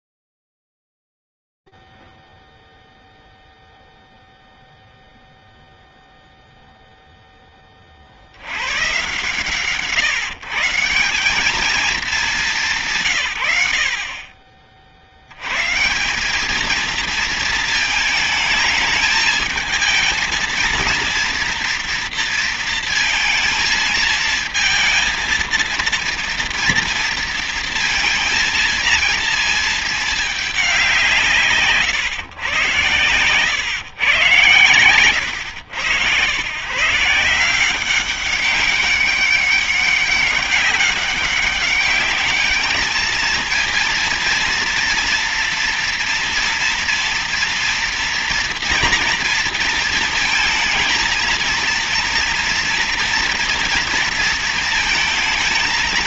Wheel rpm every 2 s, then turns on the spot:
0, 0, 0, 0, 100, 150, 200, 50, 210, 220, 230, 230, 220, 230, 230, 170, 130, 110, 130, 200, 200, 210, 230, 230, 230, 230, 230, 220.
none